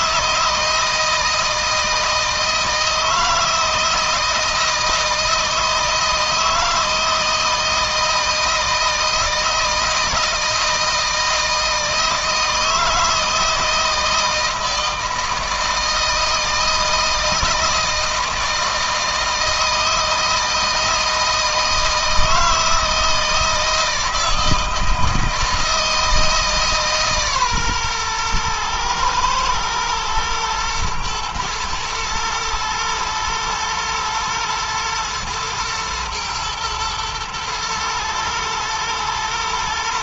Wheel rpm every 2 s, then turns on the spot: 160, 160, 160, 160, 160, 160, 160, 160, 160, 160, 160, 160, 160, 150, 120, 110, 120, 110, 110, 110.
none